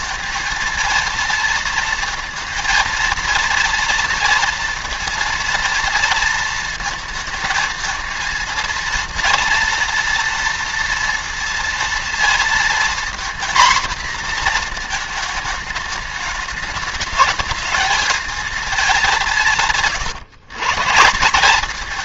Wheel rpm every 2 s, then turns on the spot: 220, 230, 230, 230, 230, 230, 230, 230, 220, 220, 140.
none